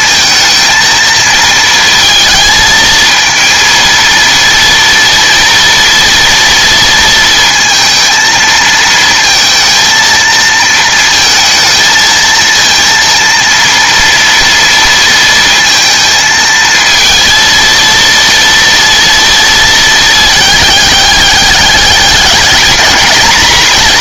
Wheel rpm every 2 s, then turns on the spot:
220, 220, 230, 230, 230, 230, 230, 230, 230, 230, 210, 220.
none